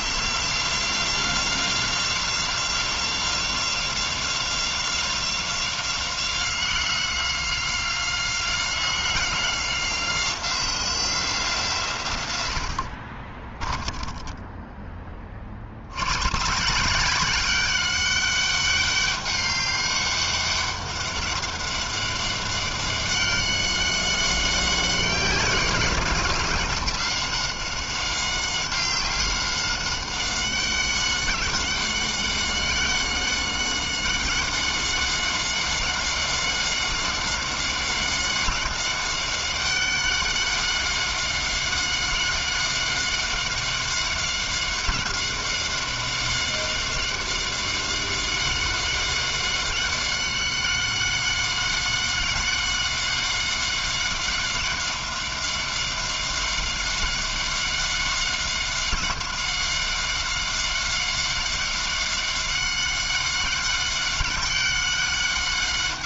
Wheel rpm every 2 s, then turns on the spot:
170, 180, 180, 180, 180, 180, 100, 10, 130, 200, 200, 200, 190, 190, 190, 190, 190, 190, 190, 190, 190, 190, 190, 190, 190, 190, 190, 190, 190, 190, 190, 190, 190.
14-16